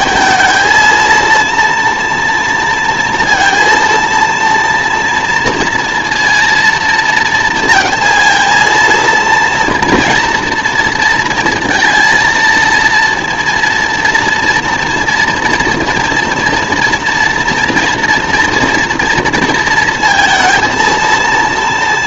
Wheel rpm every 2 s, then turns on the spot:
230, 230, 230, 230, 230, 230, 230, 240, 230, 230, 230.
none